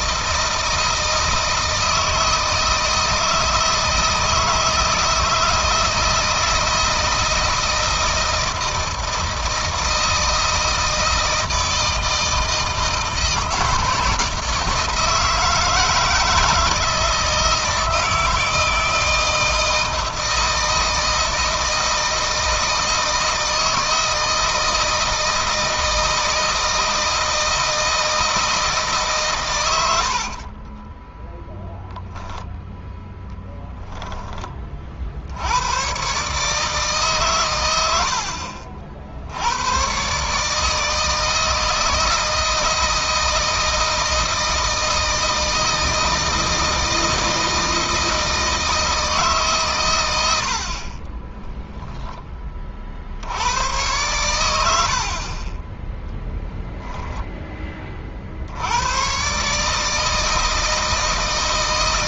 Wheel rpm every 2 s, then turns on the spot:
160, 160, 160, 160, 160, 160, 160, 160, 160, 160, 160, 160, 160, 160, 150, 30, 0, 40, 150, 60, 160, 160, 160, 160, 160, 60, 50, 70, 0, 80, 160.
30-32 50-52